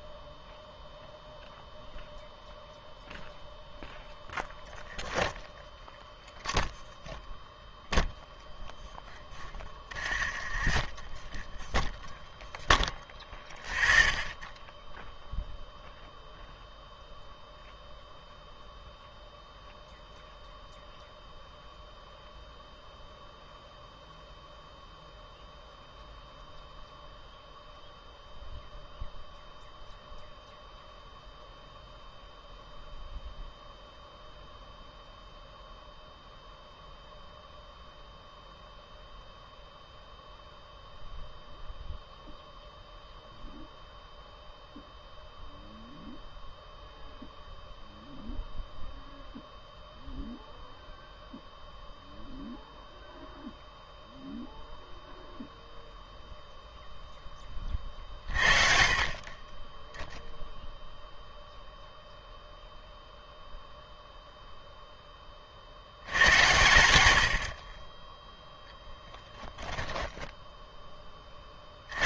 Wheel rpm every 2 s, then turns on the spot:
0, 0, 0, 0, 0, 0, 0, 0, 0, 0, 0, 0, 0, 0, 0, 0, 0, 0, 0, 0, 0, 0, 0, 0, 0, 0, 0, 0, 0, 40, 0, 0, 0, 100, 10, 10.
68-70